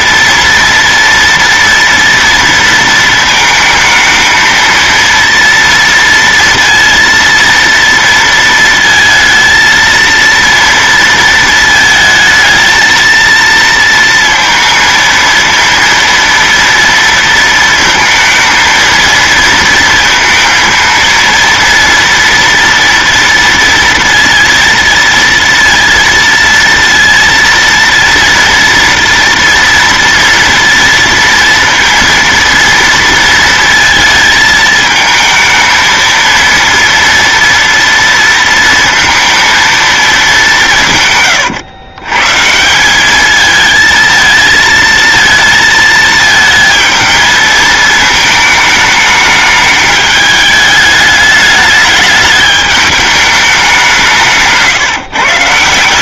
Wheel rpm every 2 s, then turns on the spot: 230, 230, 230, 230, 230, 230, 220, 230, 230, 230, 230, 230, 230, 230, 230, 230, 230, 220, 230, 230, 180, 160, 220, 220, 220, 210, 210, 150.
none